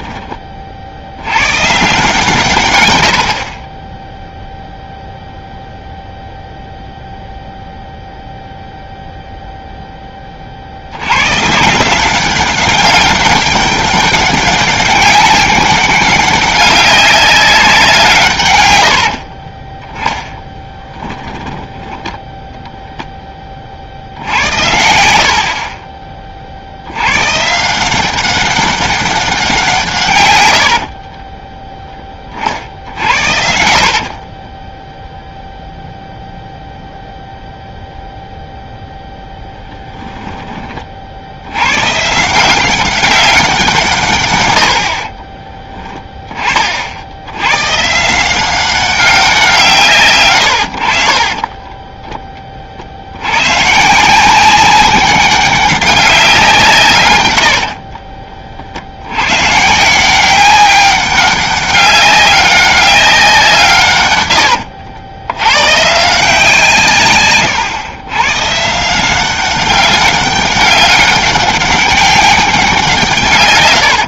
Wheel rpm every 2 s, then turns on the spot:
70, 110, 0, 0, 0, 70, 190, 200, 200, 110, 10, 0, 70, 80, 190, 70, 60, 10, 0, 0, 30, 180, 90, 50, 190, 70, 50, 190, 160, 70, 190, 190, 80, 150, 160, 200, 180.
32-36 50-52